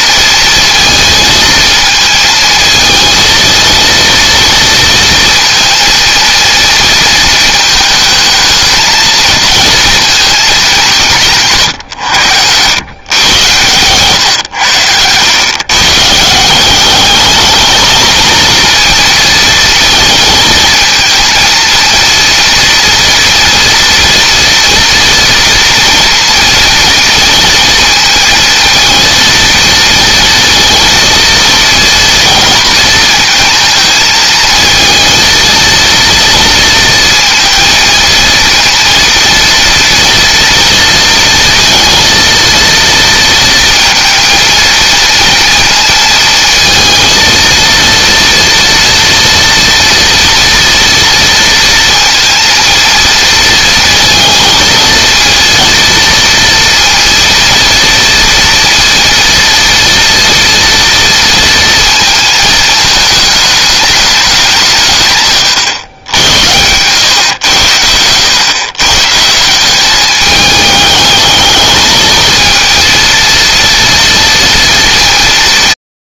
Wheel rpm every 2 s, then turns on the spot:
230, 220, 230, 230, 220, 190, 110, 100, 180, 230, 230, 230, 230, 230, 230, 230, 220, 220, 230, 230, 230, 230, 230, 230, 230, 230, 230, 230, 230, 230, 230, 220, 170, 100, 120, 210, 230, 220.
none